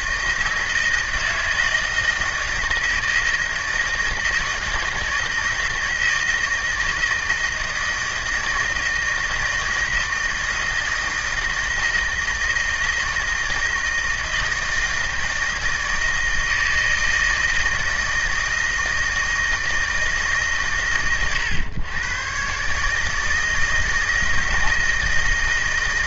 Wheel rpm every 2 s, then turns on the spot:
160, 160, 160, 160, 160, 160, 160, 160, 160, 160, 110, 150, 160.
none